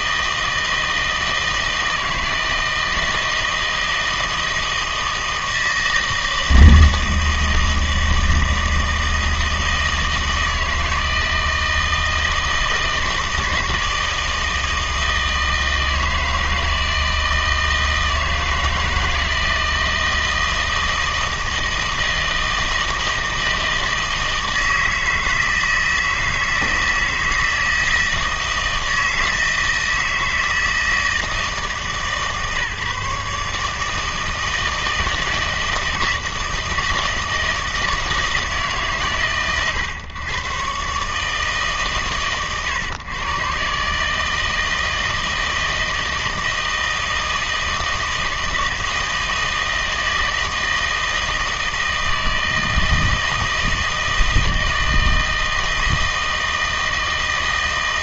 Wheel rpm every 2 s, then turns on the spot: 160, 160, 160, 160, 160, 160, 160, 160, 160, 160, 160, 160, 160, 160, 160, 160, 150, 160, 160, 150, 130, 120, 160, 160, 160, 160, 160, 160, 160.
none